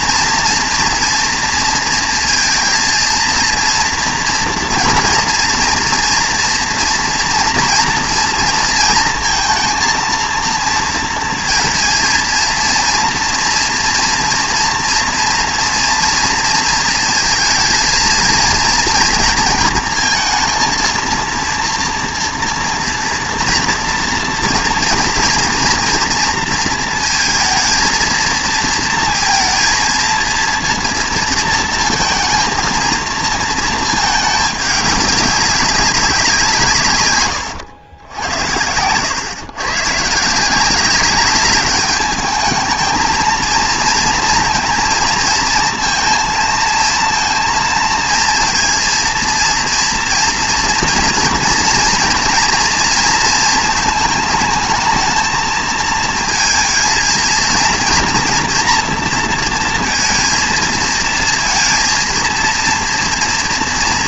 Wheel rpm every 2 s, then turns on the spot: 240, 230, 240, 230, 230, 230, 230, 230, 230, 230, 230, 230, 230, 230, 230, 230, 230, 210, 160, 90, 180, 220, 230, 230, 230, 230, 230, 220, 220, 230, 230, 230.
none